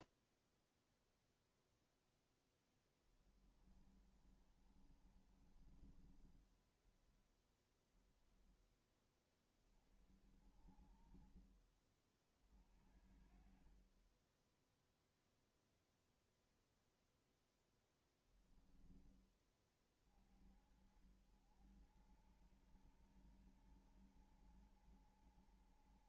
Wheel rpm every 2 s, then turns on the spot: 0, 10, 30, 20, 10, 30, 30, 20, 0, 0, 30, 70, 80.
4-8